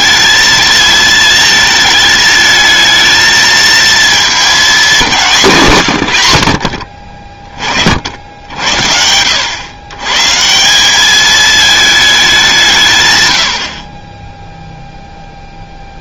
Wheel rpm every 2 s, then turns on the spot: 220, 220, 200, 50, 80, 170, 170, 0.
none